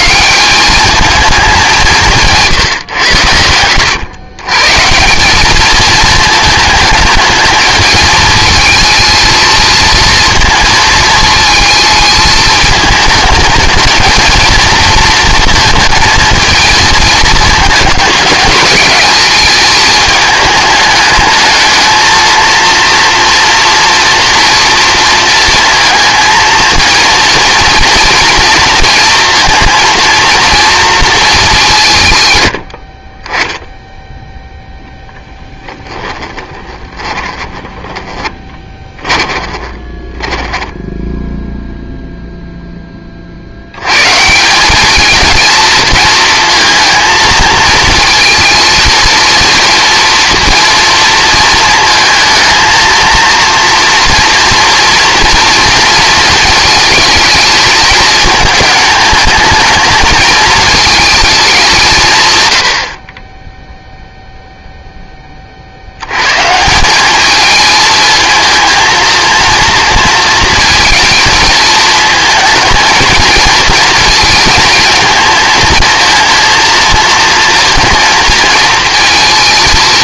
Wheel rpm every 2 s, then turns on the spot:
210, 130, 150, 210, 220, 230, 220, 230, 220, 200, 210, 230, 230, 230, 230, 230, 60, 10, 20, 30, 10, 10, 200, 230, 230, 230, 230, 230, 220, 220, 220, 70, 0, 180, 230, 230, 230, 230, 230, 230.
36-42